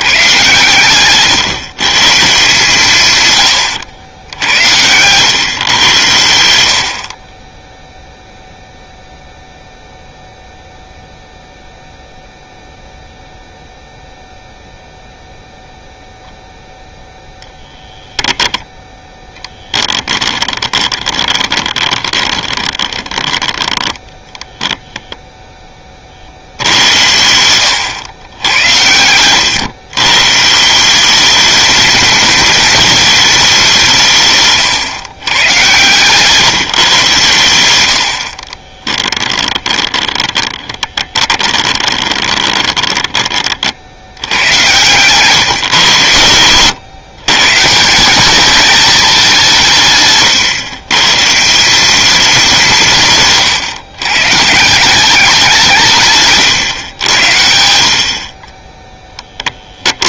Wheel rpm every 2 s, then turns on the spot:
130, 140, 90, 60, 0, 0, 0, 0, 0, 0, 20, 20, 10, 80, 100, 170, 210, 130, 130, 20, 20, 20, 110, 100, 210, 140, 170, 180, 120, 10.
20-24 38-44